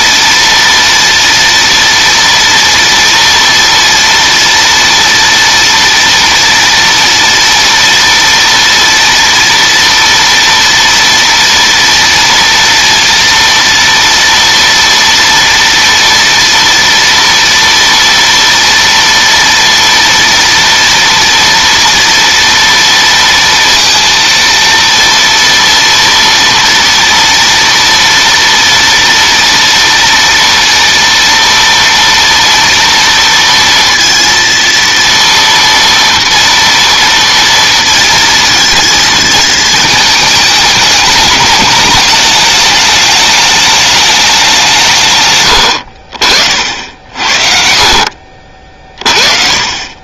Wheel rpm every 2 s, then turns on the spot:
230, 230, 230, 230, 230, 230, 230, 230, 230, 230, 230, 230, 230, 230, 230, 230, 230, 230, 240, 230, 220, 210, 200, 60, 50.
none